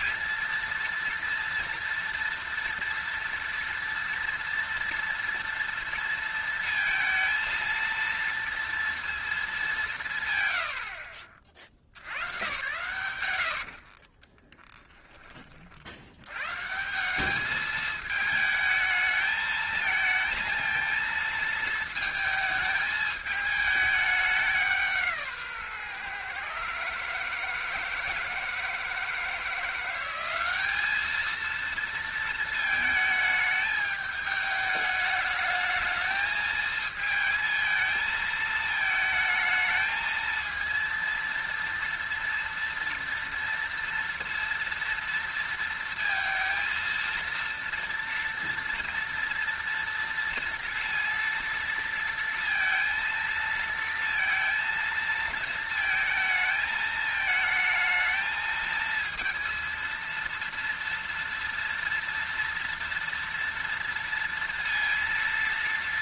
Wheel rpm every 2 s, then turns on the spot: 230, 230, 230, 230, 230, 100, 110, 10, 130, 220, 230, 220, 190, 140, 160, 200, 220, 210, 220, 220, 230, 230, 230, 230, 230, 230, 230, 230, 220, 220, 230, 230, 230.
14-16